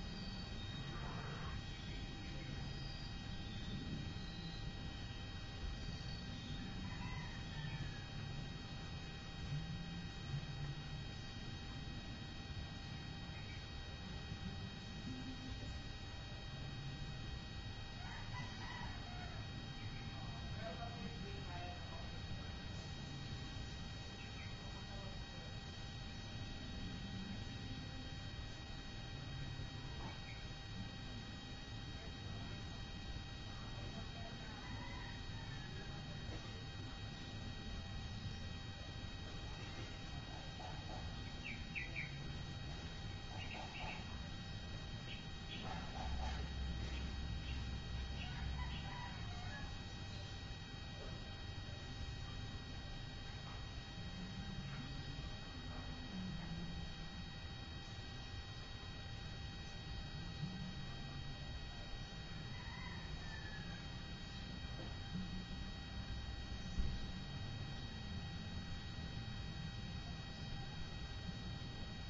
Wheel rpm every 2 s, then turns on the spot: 0, 0, 0, 0, 0, 0, 0, 0, 0, 0, 0, 0, 0, 0, 0, 0, 0, 0, 0, 0, 0, 0, 0, 0, 0, 0, 0, 0, 0, 0, 0, 0, 0, 0, 0, 0.
none